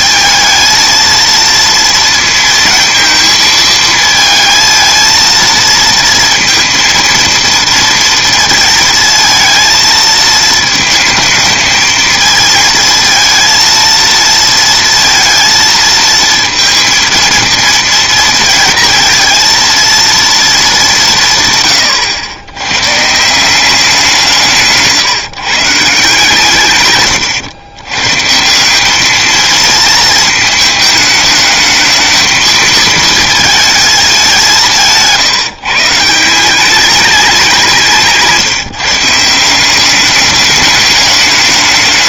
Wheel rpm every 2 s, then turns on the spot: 220, 230, 230, 230, 230, 220, 230, 230, 230, 230, 210, 130, 150, 120, 190, 220, 230, 160, 200, 150, 200.
none